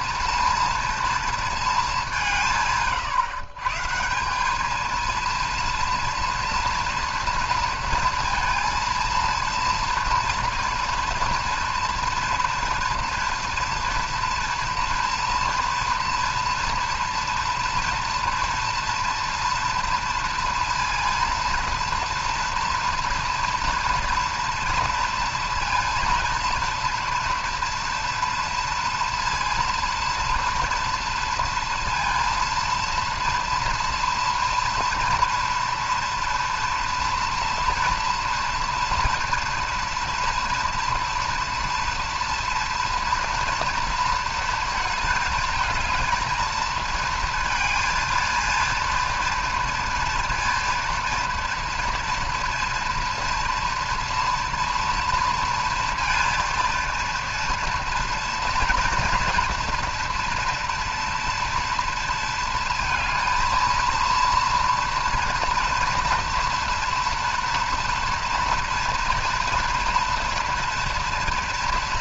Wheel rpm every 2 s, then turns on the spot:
230, 150, 210, 230, 230, 230, 240, 230, 240, 230, 230, 230, 230, 230, 230, 230, 230, 240, 230, 230, 230, 230, 230, 220, 230, 230, 230, 230, 230, 230, 230, 230, 230, 240, 230, 240.
none